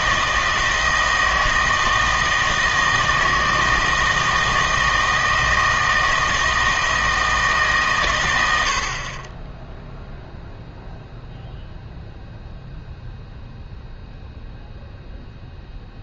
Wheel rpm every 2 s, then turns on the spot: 160, 160, 160, 160, 80, 0, 0, 0.
none